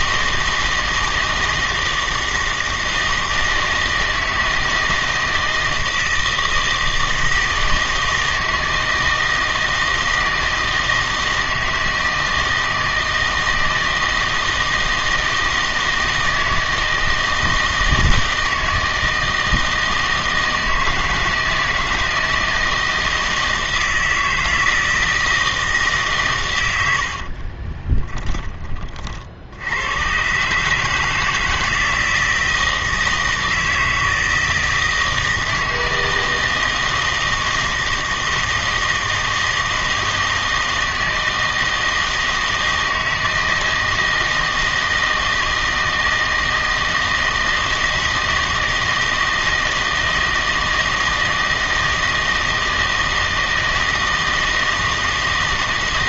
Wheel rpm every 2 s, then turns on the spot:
160, 160, 160, 160, 160, 160, 160, 160, 160, 160, 160, 160, 160, 100, 40, 150, 160, 160, 160, 160, 160, 160, 160, 160, 160, 160, 160, 160.
none